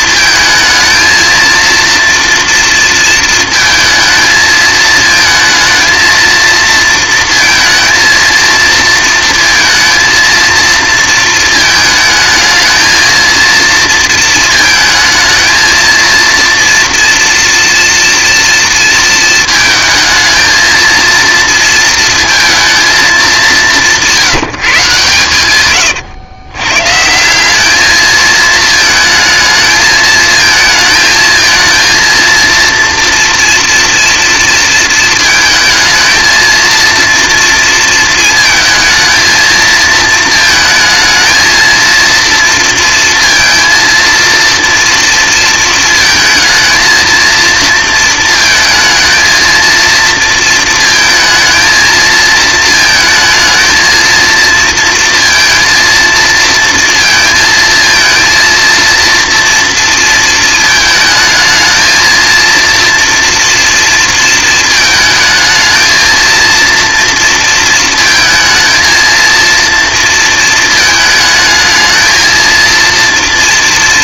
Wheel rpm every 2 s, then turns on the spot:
220, 230, 220, 230, 230, 230, 220, 220, 230, 230, 230, 230, 160, 120, 220, 220, 230, 230, 230, 230, 230, 230, 240, 220, 220, 230, 220, 230, 230, 230, 220, 230, 220, 230, 230, 220, 230.
none